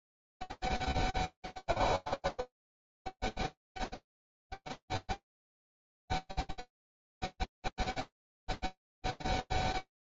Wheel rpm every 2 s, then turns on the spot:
0, 0, 0, 0, 0.
none